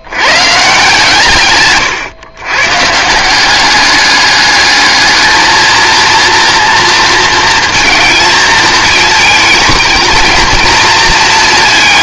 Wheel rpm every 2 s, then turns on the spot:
150, 130, 210, 230, 220, 230.
none